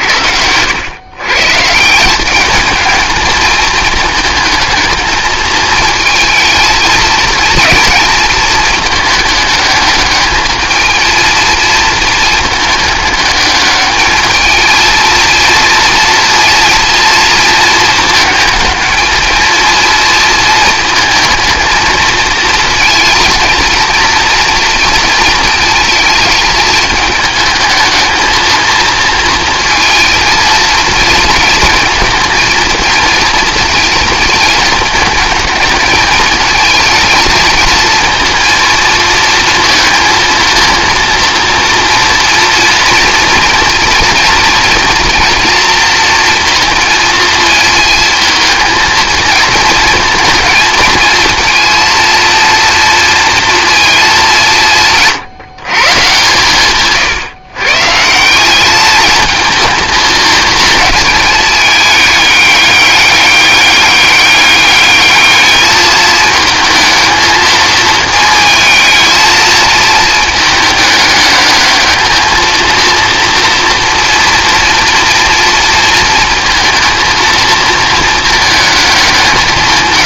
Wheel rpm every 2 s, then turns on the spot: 110, 220, 210, 220, 220, 220, 210, 220, 230, 220, 220, 230, 230, 220, 220, 230, 230, 220, 220, 230, 230, 230, 230, 230, 220, 220, 230, 170, 140, 210, 220, 200, 210, 220, 220, 210, 230, 230, 230, 200.
none